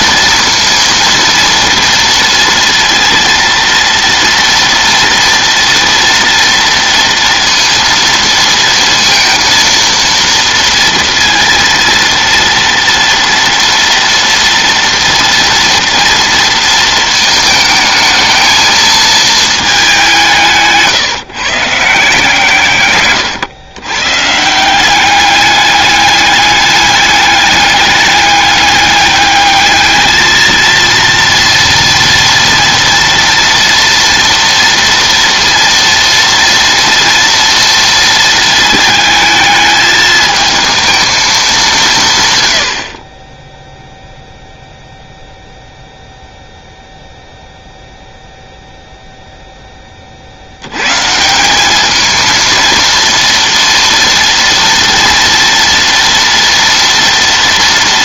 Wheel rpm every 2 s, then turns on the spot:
230, 230, 230, 230, 230, 230, 230, 240, 230, 220, 150, 120, 190, 210, 200, 230, 230, 230, 230, 220, 220, 30, 0, 0, 0, 140, 230, 230, 230.
none